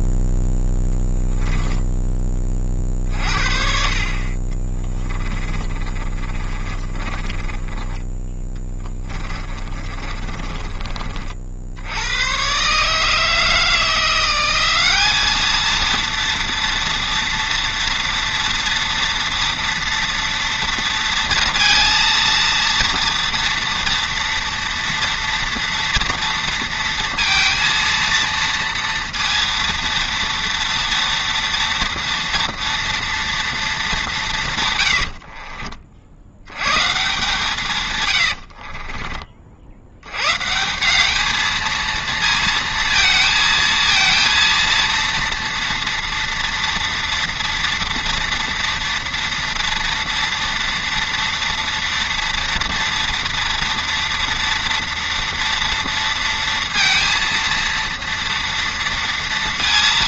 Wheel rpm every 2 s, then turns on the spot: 0, 30, 30, 30, 10, 30, 130, 190, 230, 230, 230, 230, 230, 230, 230, 230, 230, 130, 110, 70, 150, 230, 230, 240, 230, 230, 230, 230, 230, 230.
4-12 38-40